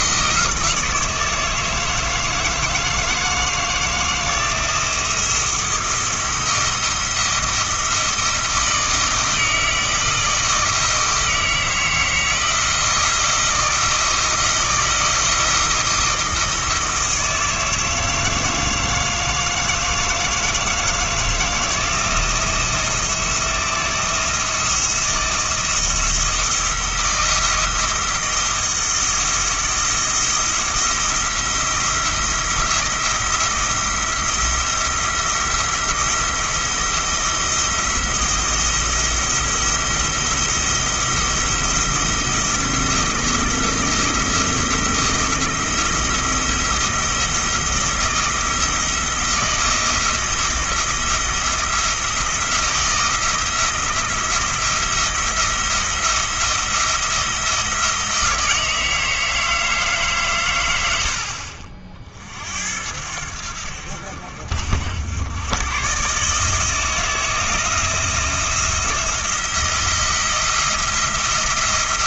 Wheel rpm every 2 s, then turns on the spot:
160, 160, 170, 170, 160, 160, 160, 160, 160, 160, 160, 170, 170, 160, 160, 170, 170, 170, 170, 170, 170, 170, 170, 170, 160, 170, 170, 170, 170, 160, 90, 70, 80, 160, 170, 170.
none